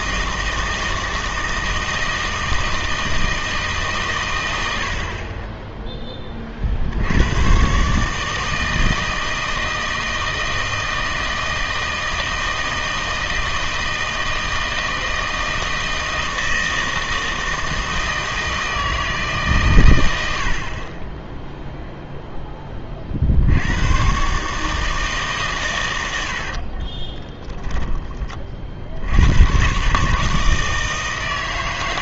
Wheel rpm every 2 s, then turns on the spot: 160, 160, 90, 30, 160, 160, 160, 160, 160, 160, 50, 20, 150, 50, 50, 160.
26-28